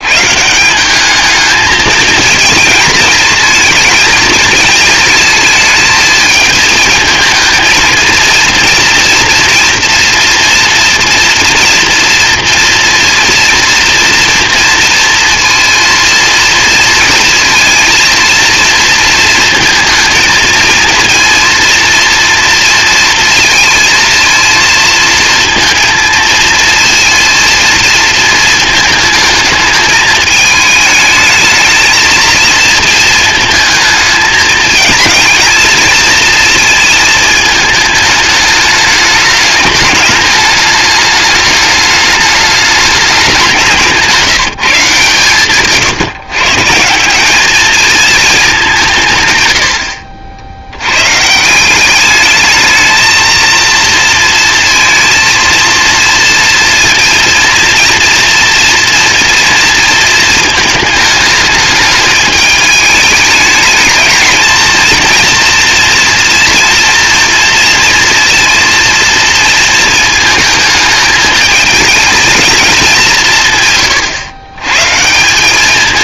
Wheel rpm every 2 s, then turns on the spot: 200, 220, 220, 220, 230, 230, 230, 230, 230, 230, 230, 230, 230, 230, 220, 220, 230, 220, 220, 210, 210, 200, 150, 170, 140, 120, 220, 230, 230, 230, 220, 220, 230, 230, 230, 220, 190, 140.
none